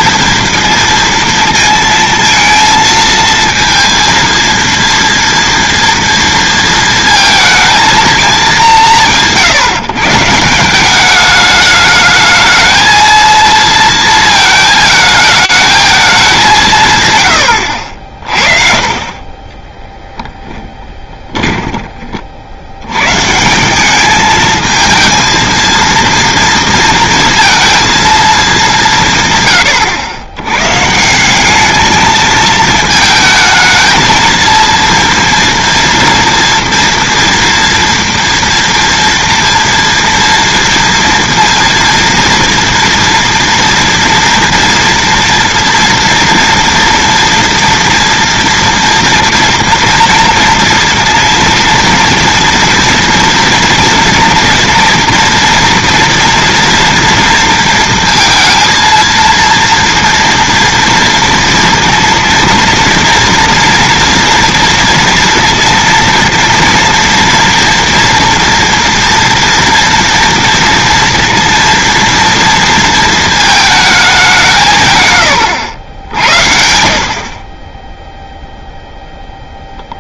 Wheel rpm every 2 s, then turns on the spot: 230, 230, 230, 230, 200, 180, 220, 220, 170, 40, 10, 70, 220, 230, 200, 130, 220, 230, 230, 230, 230, 230, 230, 230, 230, 230, 230, 230, 230, 230, 230, 230, 230, 240, 230, 230, 230, 160, 70, 0.
20-22